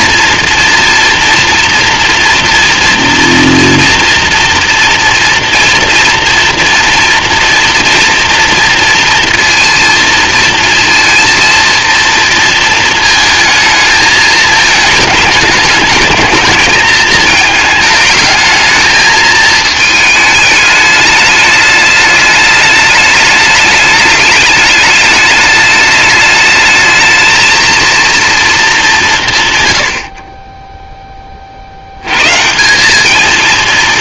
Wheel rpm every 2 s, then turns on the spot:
230, 230, 230, 230, 230, 230, 220, 220, 220, 220, 210, 210, 210, 220, 210, 10, 170.
none